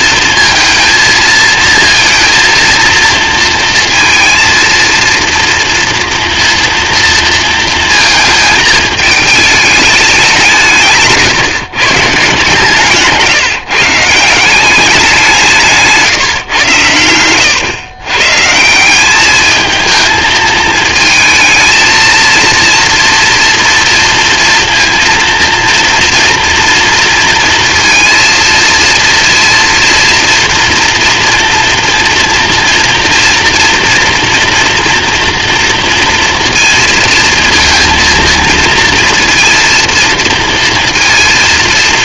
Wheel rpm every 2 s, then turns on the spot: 230, 230, 230, 230, 220, 150, 150, 190, 120, 180, 220, 230, 230, 230, 230, 230, 240, 230, 230, 230, 230.
none